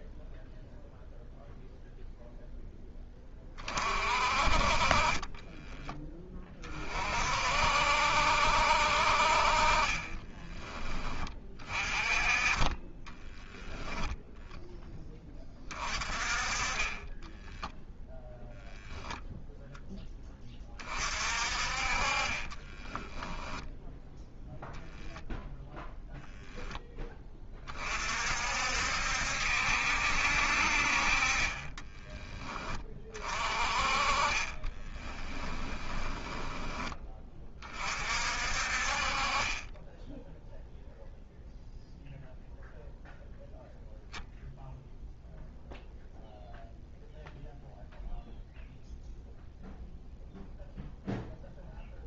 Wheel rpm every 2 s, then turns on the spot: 0, 0, 40, 30, 70, 20, 30, 10, 20, 0, 30, 20, 0, 0, 60, 60, 20, 20, 10, 50, 0, 0, 0, 0, 0, 0.
22-24 34-38